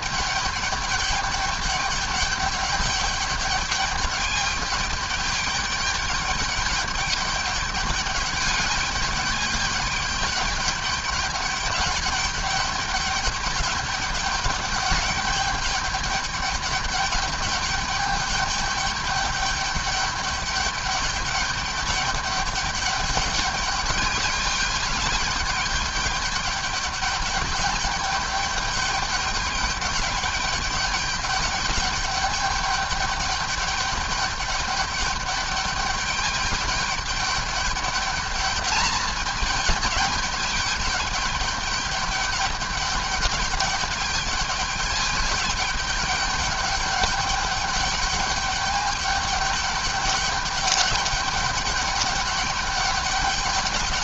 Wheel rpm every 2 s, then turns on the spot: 210, 200, 210, 200, 200, 200, 200, 210, 200, 210, 200, 210, 210, 210, 200, 200, 200, 200, 210, 220, 210, 210, 210, 210, 200, 210, 200.
none